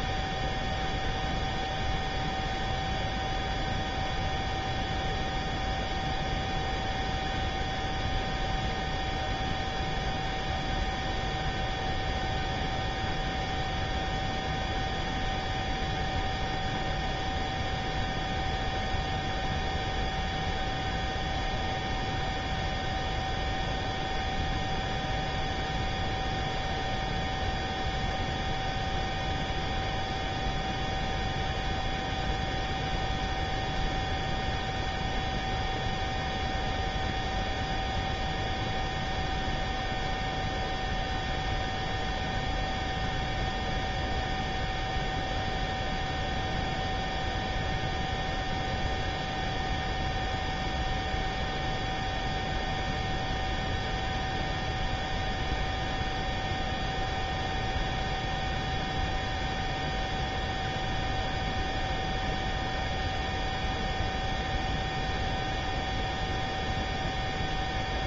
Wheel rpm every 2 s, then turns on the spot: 0, 0, 0, 0, 0, 0, 0, 0, 0, 0, 0, 0, 0, 0, 0, 0, 0, 0, 0, 0, 0, 0, 0, 0, 0, 0, 0, 0, 0, 0, 0, 0, 0, 0.
none